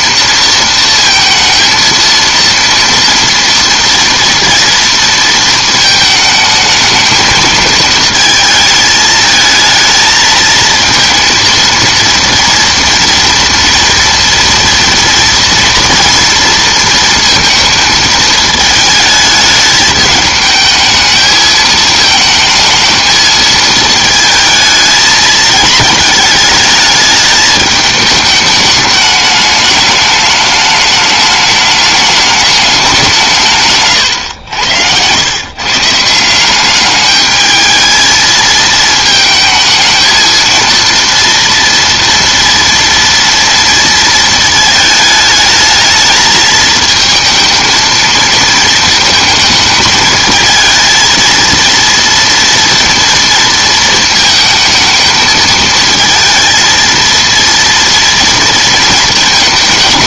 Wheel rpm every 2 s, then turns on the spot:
230, 230, 230, 220, 220, 230, 230, 240, 230, 220, 220, 220, 220, 220, 210, 210, 210, 90, 190, 220, 230, 230, 220, 220, 220, 220, 230, 220, 220, 230.
34-36